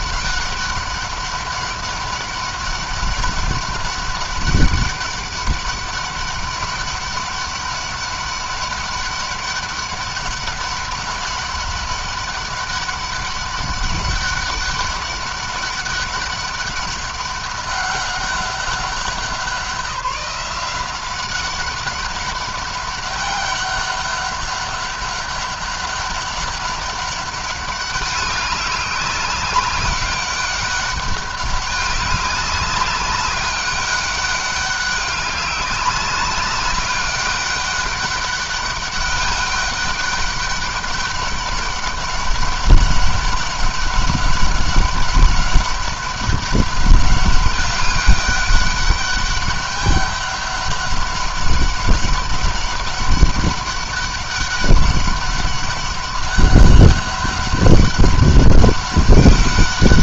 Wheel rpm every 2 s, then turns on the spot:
200, 200, 200, 200, 200, 200, 200, 200, 200, 190, 180, 200, 200, 200, 200, 200, 200, 200, 200, 200, 200, 200, 200, 200, 200, 200, 200, 200, 200, 200.
none